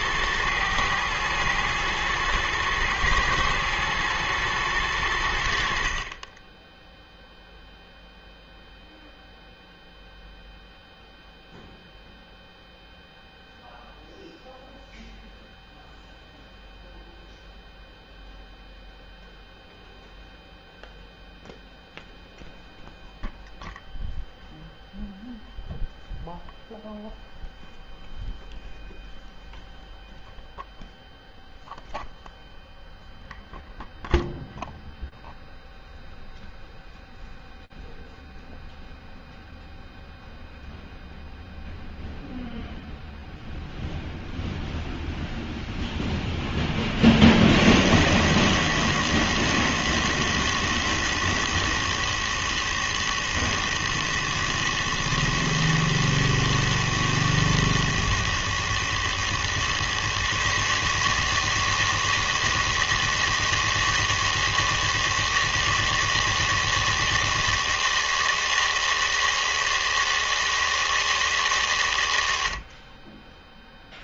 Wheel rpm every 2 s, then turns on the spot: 110, 110, 100, 0, 0, 0, 0, 0, 0, 0, 0, 0, 0, 0, 0, 0, 0, 0, 0, 0, 0, 0, 0, 30, 110, 110, 120, 110, 110, 120, 160, 160, 160, 160, 160, 140, 10.
none